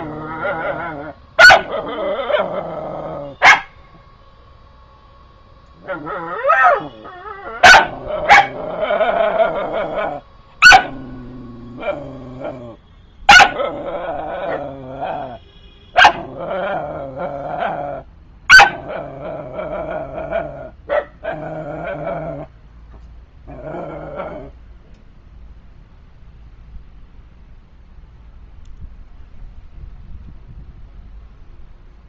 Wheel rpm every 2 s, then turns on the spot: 0, 0, 0, 0, 0, 0, 0, 0, 0, 0, 0, 0, 0, 0, 0, 0.
none